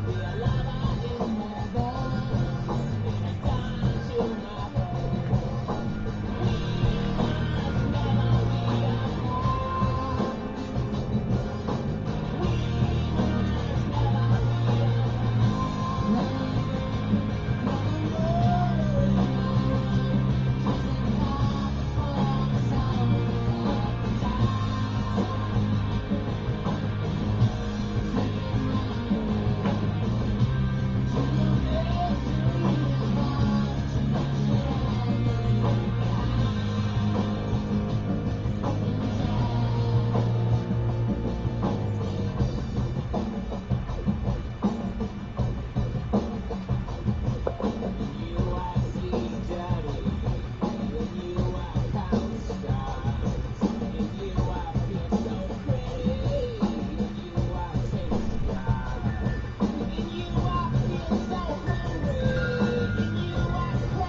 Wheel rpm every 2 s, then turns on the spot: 0, 0, 0, 0, 0, 0, 0, 0, 0, 0, 0, 0, 0, 0, 0, 0, 0, 0, 0, 0, 0, 0, 0, 0, 0, 0, 0, 0, 0, 0, 0, 0.
none